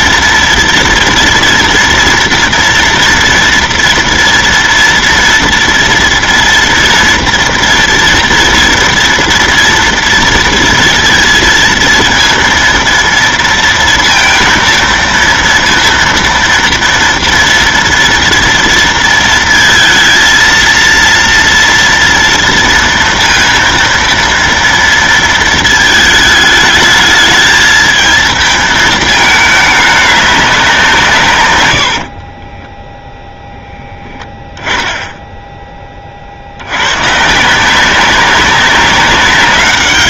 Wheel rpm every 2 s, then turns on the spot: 230, 230, 230, 230, 230, 230, 230, 230, 230, 230, 230, 230, 230, 220, 220, 190, 10, 10, 70, 200.
32-34